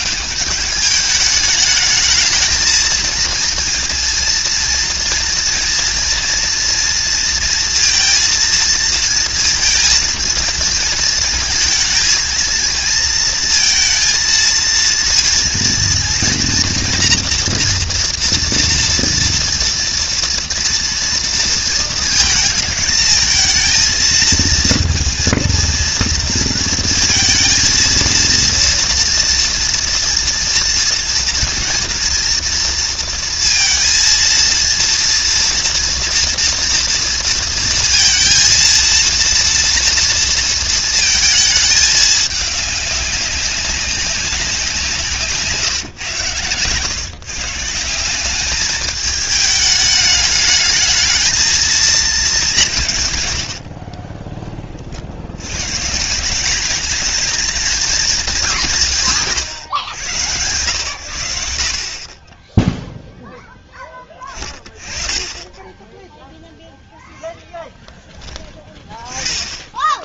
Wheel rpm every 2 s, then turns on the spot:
210, 220, 230, 230, 230, 230, 230, 230, 230, 230, 230, 220, 230, 230, 230, 230, 230, 230, 230, 230, 230, 200, 180, 140, 210, 220, 150, 50, 220, 170, 100, 0, 20, 0, 20.
none